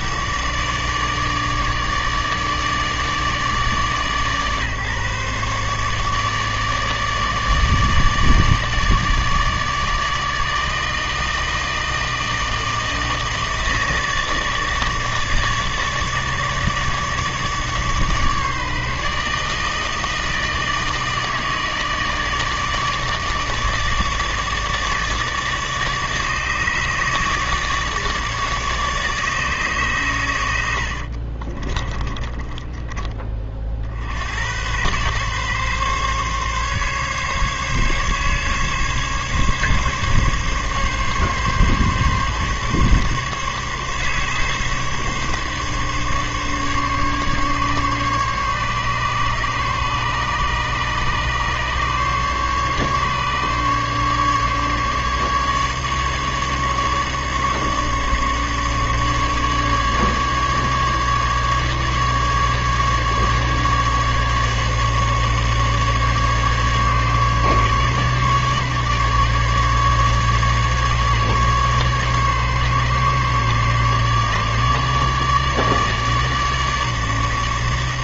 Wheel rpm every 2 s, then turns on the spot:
150, 150, 140, 150, 150, 160, 160, 150, 150, 150, 160, 150, 150, 150, 150, 80, 20, 100, 140, 140, 140, 140, 140, 140, 140, 140, 140, 140, 150, 150, 150, 150, 150, 150, 150, 140, 140, 150, 150.
30-34